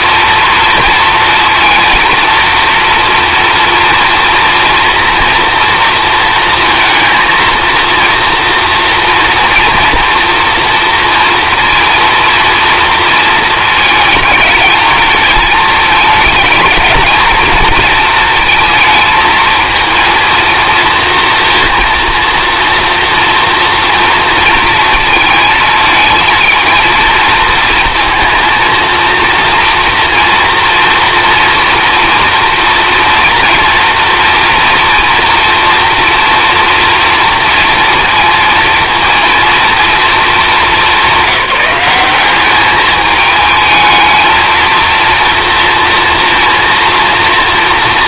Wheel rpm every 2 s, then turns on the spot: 230, 230, 230, 230, 230, 230, 230, 220, 220, 230, 230, 240, 230, 220, 220, 230, 240, 240, 230, 230, 210, 210, 230, 230.
none